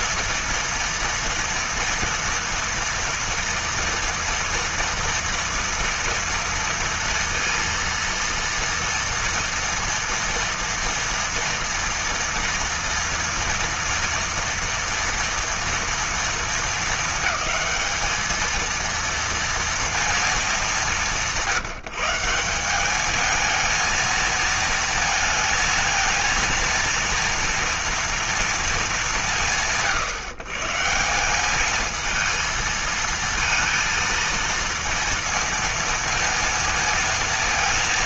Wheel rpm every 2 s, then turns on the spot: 230, 230, 230, 230, 230, 230, 230, 240, 220, 230, 200, 200, 230, 230, 190, 160, 230, 230, 230.
none